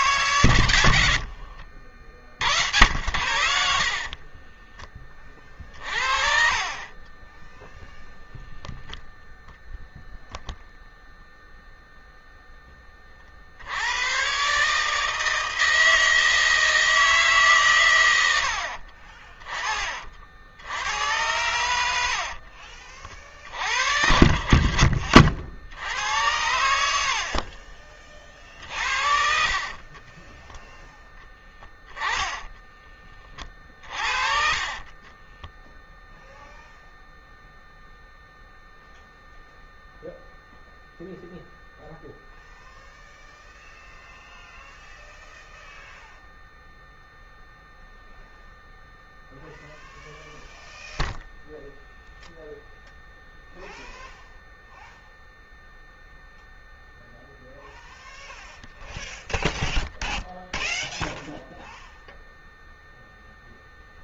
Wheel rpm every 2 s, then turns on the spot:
120, 80, 20, 40, 0, 0, 10, 130, 160, 70, 70, 60, 70, 90, 40, 10, 10, 30, 0, 0, 0, 0, 0, 0, 0, 0, 0, 0, 0, 0, 0, 0.
4-8 22-24 28-36